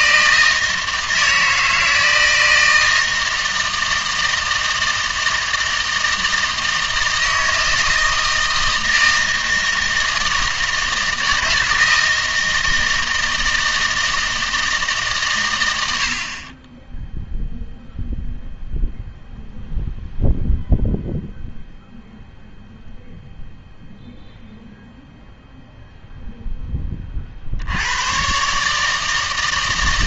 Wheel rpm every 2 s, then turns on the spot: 160, 160, 160, 160, 160, 160, 160, 160, 20, 0, 0, 0, 0, 10, 140.
none